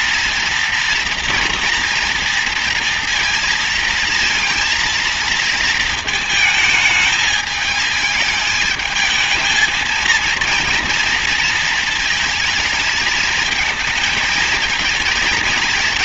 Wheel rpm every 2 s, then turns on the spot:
230, 230, 230, 220, 210, 220, 220, 220.
none